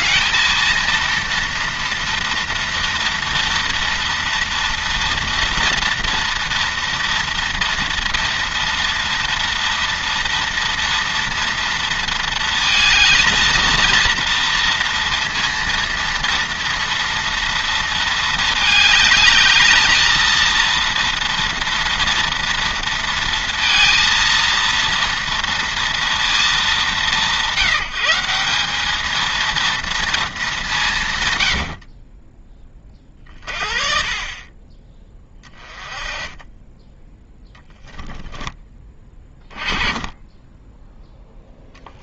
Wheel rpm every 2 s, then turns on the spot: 230, 240, 230, 230, 230, 230, 230, 230, 230, 220, 230, 230, 230, 190, 210, 170, 30, 20, 10, 20, 10.
32-34